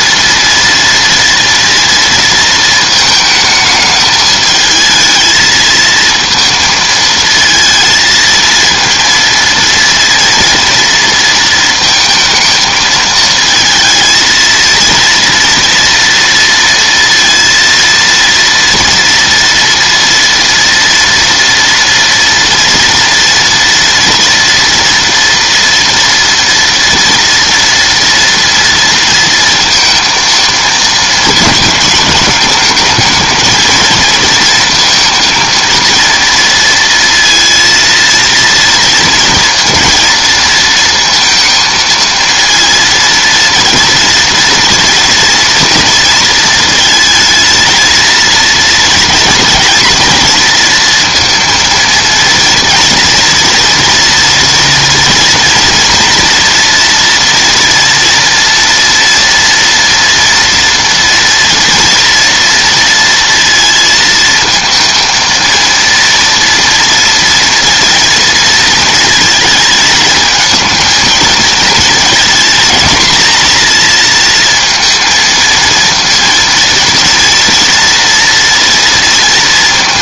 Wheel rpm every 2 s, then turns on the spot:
230, 230, 220, 230, 230, 230, 220, 230, 230, 230, 230, 230, 230, 230, 230, 230, 210, 230, 230, 230, 230, 230, 230, 220, 230, 230, 230, 230, 230, 230, 230, 230, 230, 230, 220, 220, 230, 230, 230, 230.
none